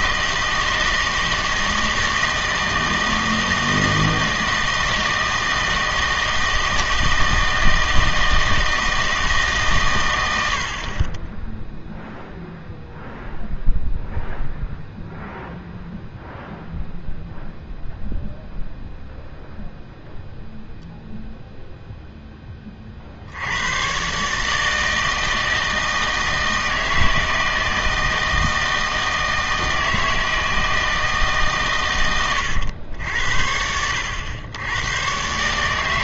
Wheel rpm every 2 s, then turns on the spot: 160, 160, 160, 160, 160, 60, 0, 0, 0, 0, 0, 20, 160, 160, 160, 160, 100, 100.
none